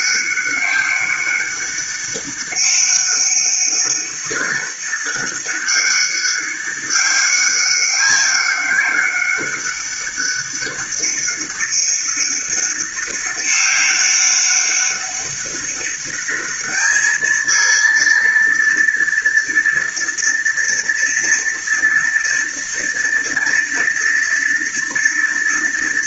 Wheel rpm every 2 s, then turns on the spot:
200, 200, 200, 200, 200, 200, 200, 200, 220, 230, 230, 230, 230.
none